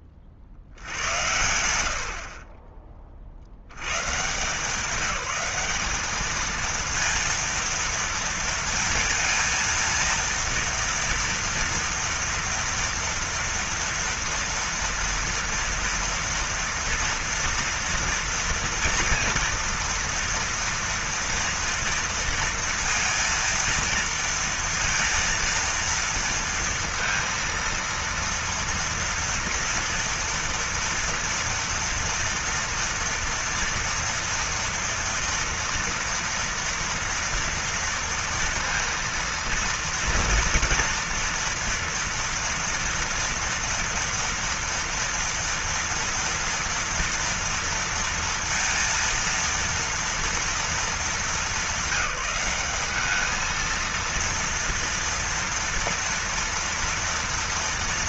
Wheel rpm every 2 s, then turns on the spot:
40, 20, 170, 230, 230, 230, 230, 230, 230, 230, 230, 230, 230, 230, 230, 230, 240, 230, 240, 230, 240, 230, 230, 230, 230, 230, 200, 230, 230.
none